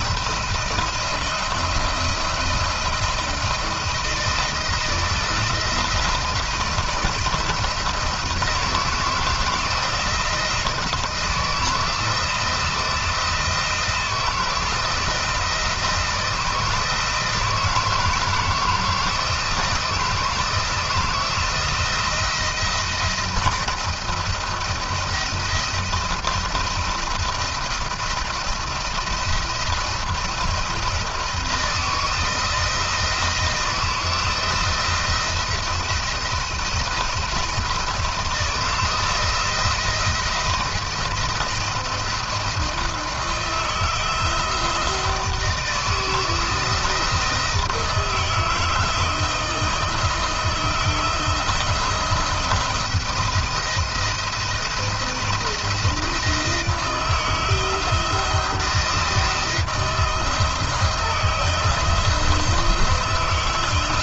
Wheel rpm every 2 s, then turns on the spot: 170, 170, 170, 170, 160, 170, 160, 170, 160, 160, 160, 170, 160, 170, 170, 170, 160, 170, 170, 170, 170, 170, 170, 160, 160, 170, 170, 170, 160, 170, 160, 160.
none